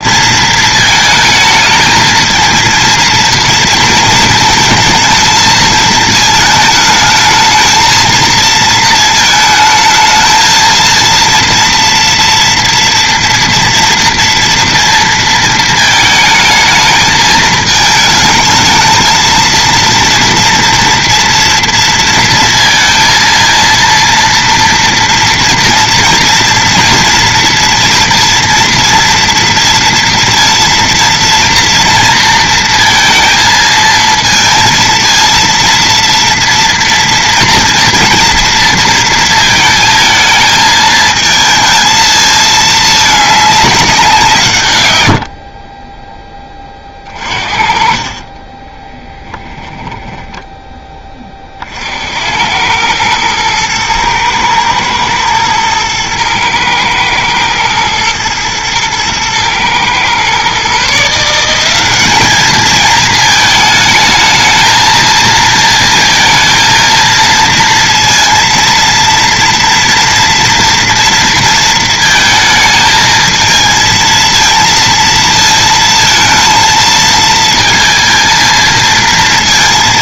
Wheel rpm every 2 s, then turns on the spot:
230, 230, 220, 220, 220, 230, 230, 230, 220, 220, 230, 230, 230, 230, 230, 230, 230, 230, 230, 230, 220, 220, 120, 20, 30, 10, 100, 110, 110, 110, 130, 220, 220, 220, 230, 230, 220, 230, 230, 230.
none